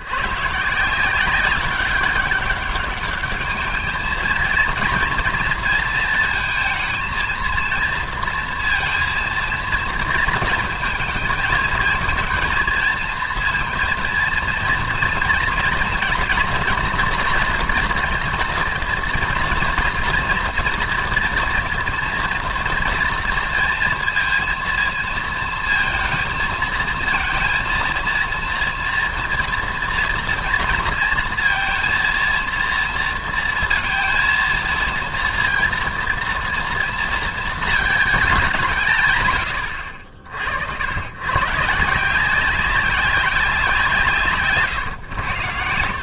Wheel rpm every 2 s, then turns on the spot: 160, 200, 230, 230, 230, 220, 230, 230, 240, 240, 230, 230, 230, 230, 230, 230, 230, 230, 230, 160, 90, 190, 130.
none